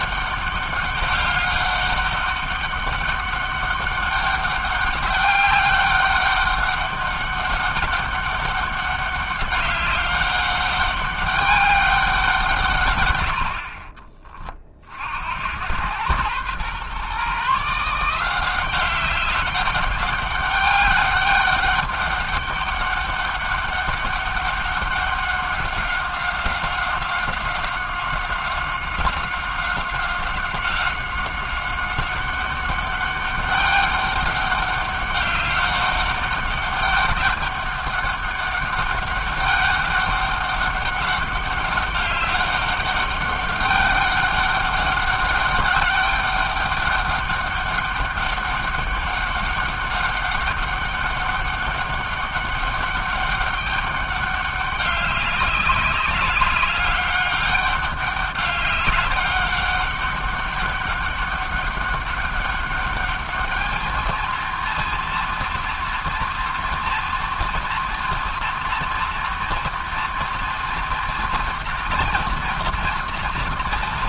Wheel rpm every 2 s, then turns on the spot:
200, 200, 200, 200, 200, 200, 160, 30, 120, 180, 200, 200, 200, 190, 190, 190, 200, 200, 200, 200, 200, 200, 200, 200, 200, 200, 200, 200, 200, 200, 200, 200, 230, 230, 230, 230, 230.
none